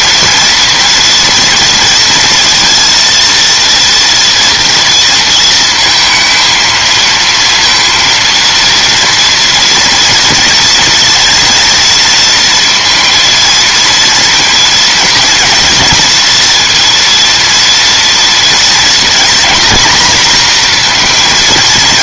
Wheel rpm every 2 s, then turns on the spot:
230, 230, 230, 230, 230, 230, 230, 230, 230, 230, 240.
none